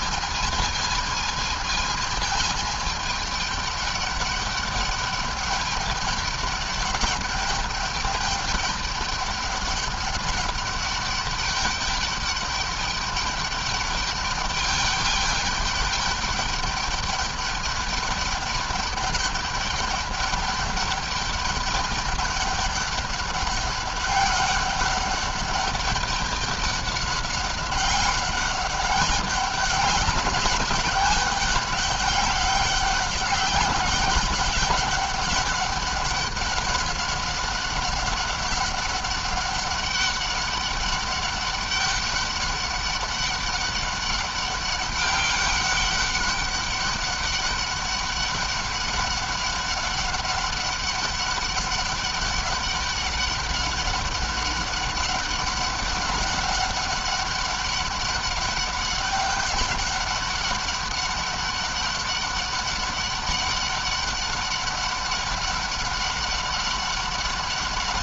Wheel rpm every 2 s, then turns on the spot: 220, 210, 200, 210, 210, 200, 200, 200, 210, 210, 200, 200, 200, 200, 200, 200, 200, 200, 200, 200, 200, 200, 200, 200, 200, 200, 200, 200, 200, 200, 200, 200, 200, 200.
none